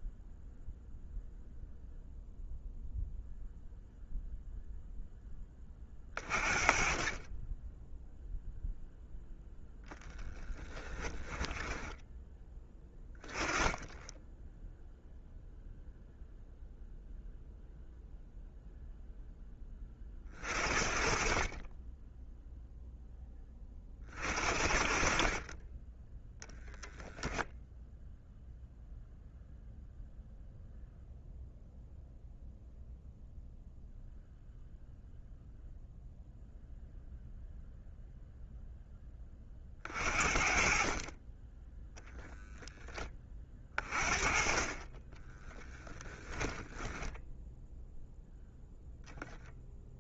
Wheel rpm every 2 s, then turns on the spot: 0, 0, 0, 30, 0, 10, 20, 0, 0, 0, 40, 0, 50, 0, 0, 0, 0, 0, 0, 10, 40, 10, 20, 10, 0.
10-12 46-48